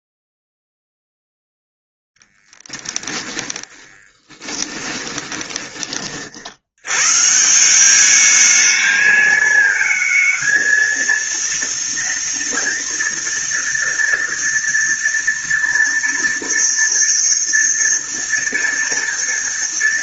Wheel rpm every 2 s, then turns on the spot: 0, 10, 10, 70, 210, 220, 230, 230, 230, 230.
4-6